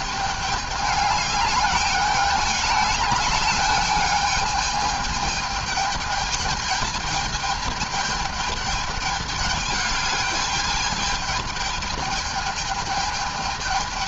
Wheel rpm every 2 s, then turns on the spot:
210, 210, 210, 220, 210, 220, 210.
none